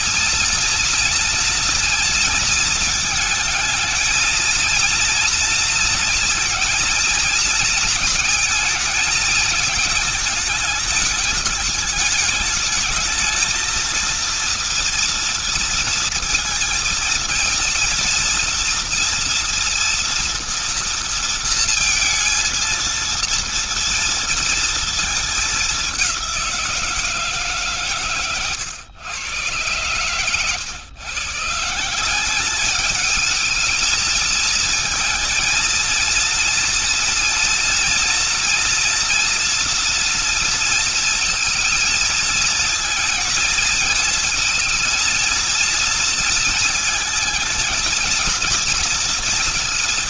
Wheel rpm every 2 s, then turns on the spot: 230, 230, 230, 230, 220, 220, 210, 230, 220, 230, 230, 230, 230, 180, 120, 130, 200, 230, 230, 230, 230, 220, 230, 220, 230.
none